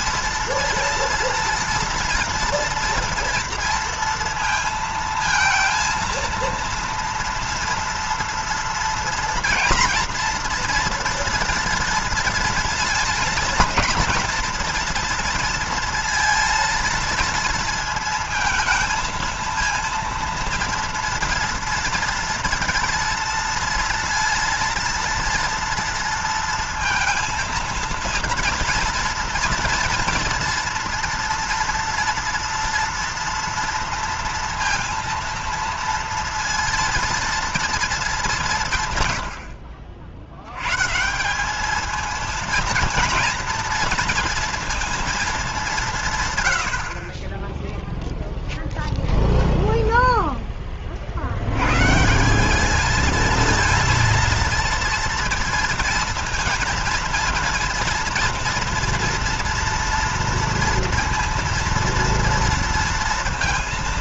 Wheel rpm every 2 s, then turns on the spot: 230, 230, 230, 230, 230, 240, 230, 240, 230, 220, 230, 230, 230, 230, 230, 230, 240, 230, 230, 170, 130, 220, 230, 80, 0, 30, 200, 230, 230, 230, 230, 230.
none